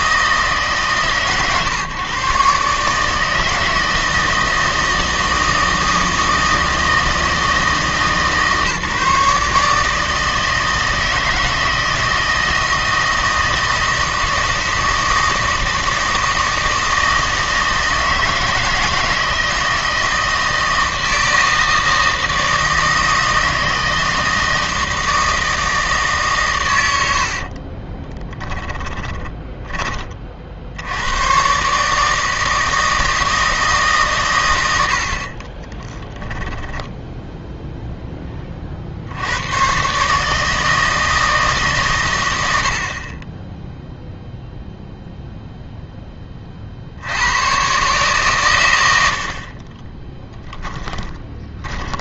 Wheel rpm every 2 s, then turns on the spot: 140, 150, 160, 160, 150, 160, 160, 160, 160, 160, 160, 160, 160, 100, 10, 80, 160, 90, 10, 50, 160, 70, 0, 70, 90, 20.
28-30 36-38 50-52